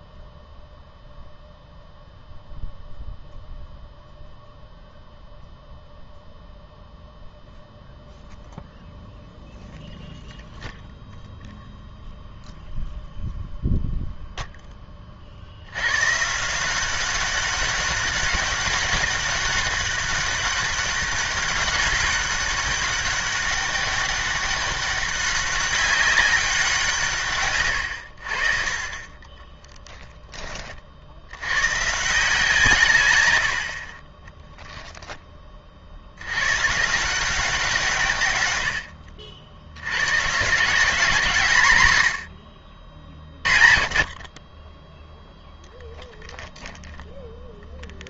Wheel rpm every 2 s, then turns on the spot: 0, 0, 0, 0, 0, 0, 0, 0, 170, 200, 200, 200, 200, 180, 40, 30, 160, 0, 120, 90, 160, 60, 30, 0.
none